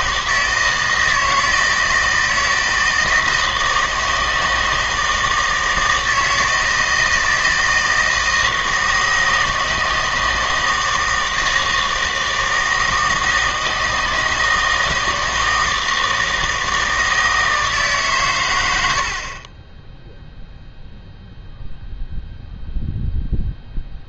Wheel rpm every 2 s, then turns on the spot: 160, 160, 160, 160, 160, 160, 160, 160, 160, 80, 0, 0.
none